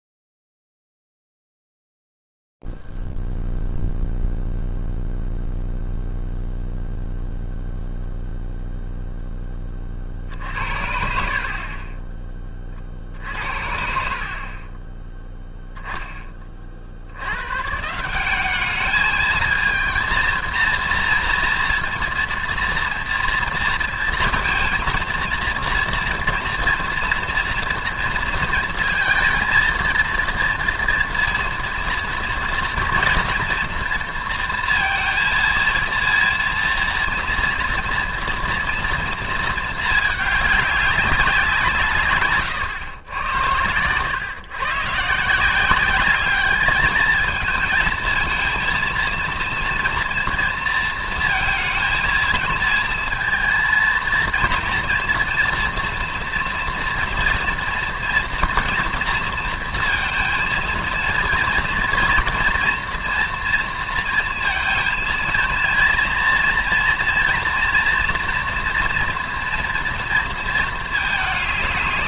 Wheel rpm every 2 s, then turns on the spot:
0, 0, 0, 0, 0, 50, 20, 50, 30, 200, 230, 230, 230, 230, 230, 230, 230, 230, 230, 230, 200, 110, 130, 210, 230, 230, 230, 240, 240, 230, 230, 240, 230, 230, 240, 220.
none